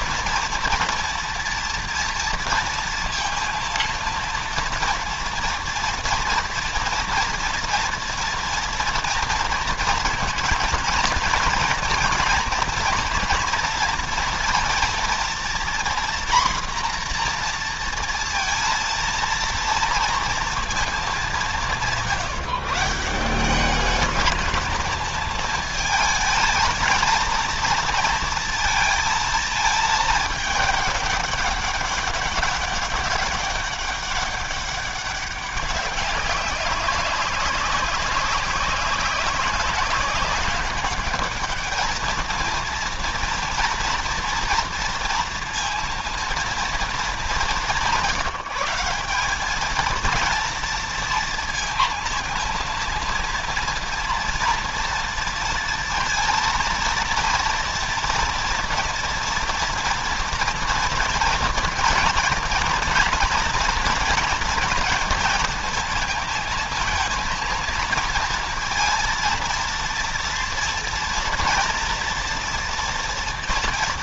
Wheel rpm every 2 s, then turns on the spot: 230, 230, 230, 230, 240, 230, 230, 230, 240, 230, 210, 160, 220, 220, 230, 210, 200, 190, 200, 190, 200, 230, 230, 220, 180, 230, 230, 230, 230, 240, 230, 230, 230, 220, 230, 230, 230.
none